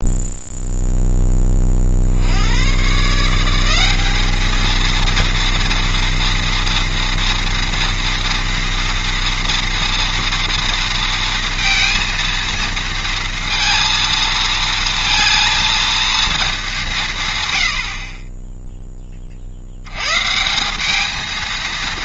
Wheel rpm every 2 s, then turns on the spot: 10, 140, 230, 230, 230, 230, 230, 230, 160, 20, 210.
none